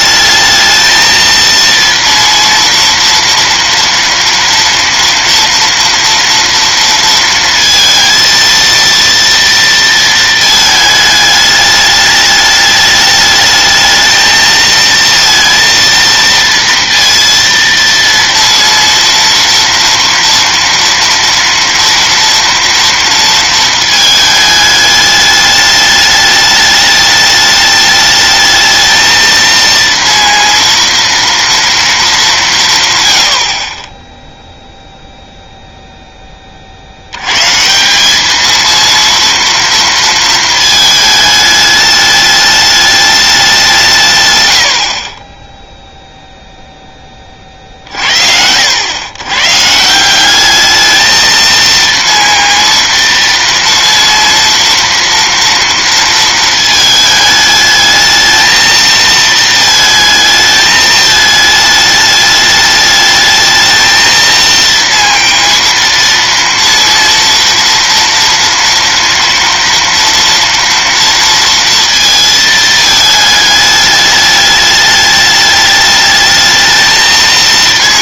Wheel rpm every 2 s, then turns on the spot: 220, 230, 230, 230, 230, 220, 210, 230, 230, 230, 230, 230, 210, 210, 220, 230, 170, 0, 30, 220, 220, 210, 100, 0, 80, 210, 230, 230, 220, 220, 220, 210, 230, 230, 230, 240, 220, 210, 220.
none